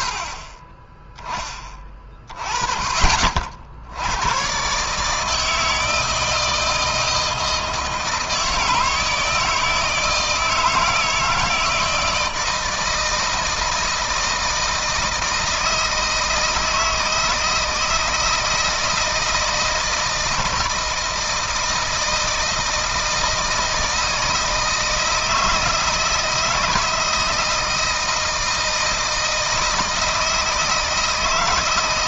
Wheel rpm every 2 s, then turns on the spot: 40, 30, 120, 160, 160, 160, 160, 160, 160, 160, 160, 160, 160, 160, 160, 160.
0-2